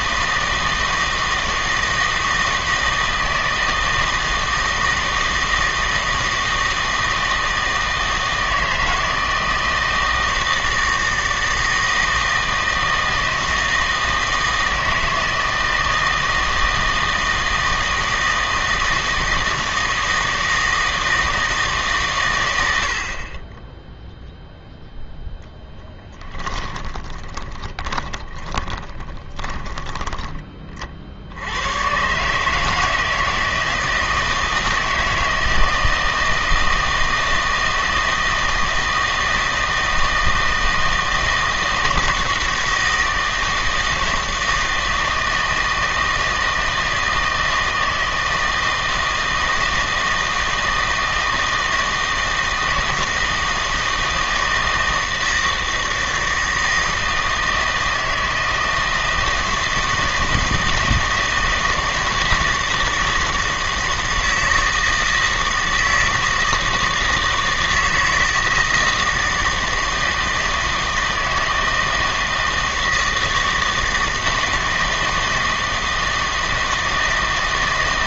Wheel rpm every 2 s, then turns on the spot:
160, 160, 160, 160, 160, 160, 160, 160, 160, 160, 160, 100, 0, 20, 10, 30, 150, 160, 160, 160, 160, 160, 160, 160, 160, 160, 160, 160, 160, 160, 160, 160, 160, 160, 160, 160, 160, 160, 160.
26-30